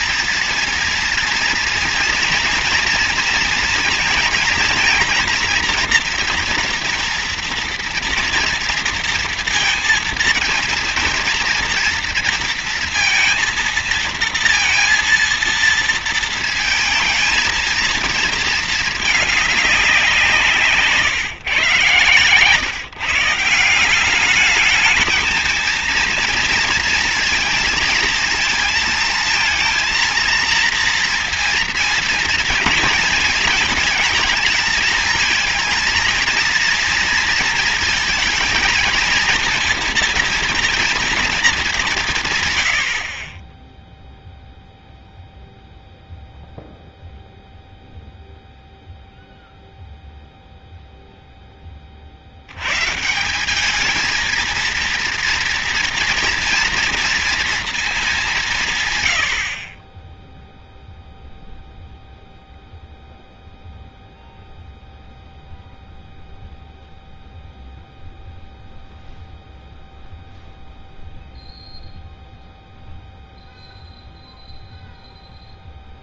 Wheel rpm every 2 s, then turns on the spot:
230, 240, 230, 240, 230, 230, 230, 230, 230, 220, 160, 130, 200, 230, 230, 230, 230, 220, 230, 220, 230, 130, 0, 0, 0, 0, 70, 230, 230, 180, 0, 0, 0, 0, 0, 0, 0, 0.
none